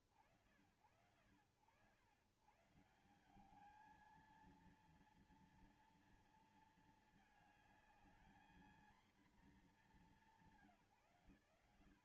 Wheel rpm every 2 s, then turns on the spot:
70, 110, 220, 230, 220, 220.
none